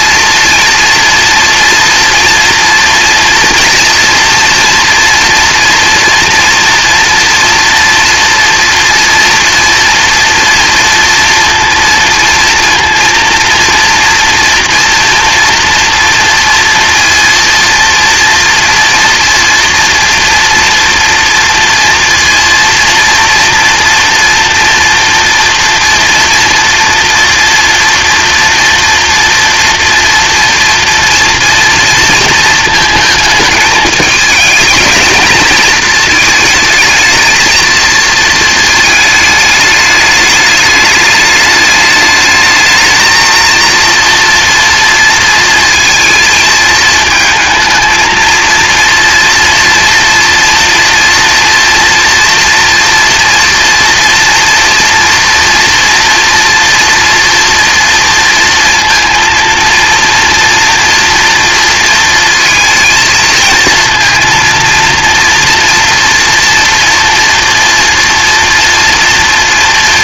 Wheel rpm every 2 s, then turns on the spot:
230, 240, 230, 230, 230, 230, 230, 230, 230, 240, 230, 230, 230, 230, 240, 230, 220, 220, 220, 220, 210, 220, 230, 220, 230, 240, 240, 230, 240, 230, 230, 230, 230, 230, 230.
none